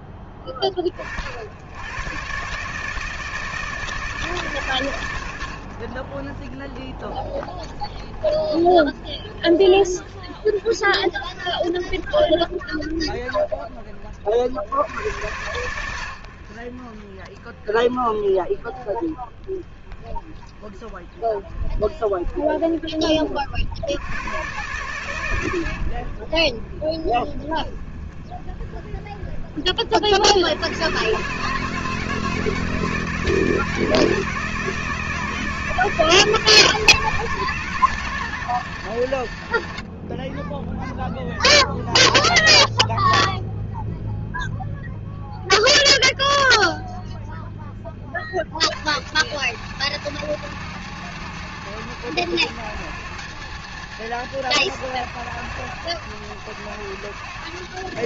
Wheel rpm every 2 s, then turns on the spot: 30, 150, 110, 20, 30, 20, 30, 90, 30, 20, 20, 30, 130, 30, 20, 120, 160, 160, 170, 110, 10, 10, 10, 10, 110, 140, 140, 130, 120.
none